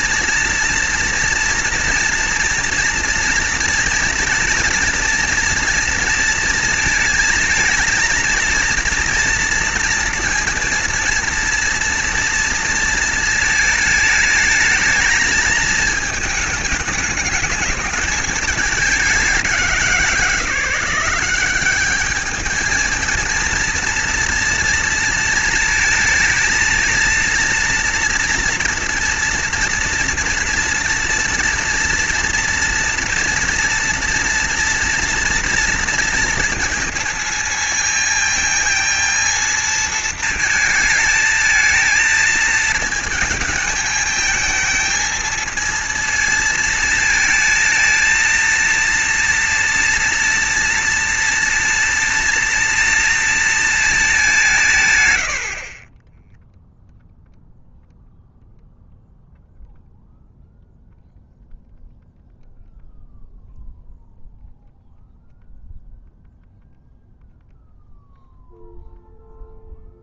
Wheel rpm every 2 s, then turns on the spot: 230, 240, 230, 230, 230, 230, 230, 220, 210, 210, 170, 220, 230, 230, 230, 230, 230, 230, 230, 230, 220, 220, 220, 230, 230, 230, 230, 160, 0, 0, 0, 0, 0, 0, 0.
none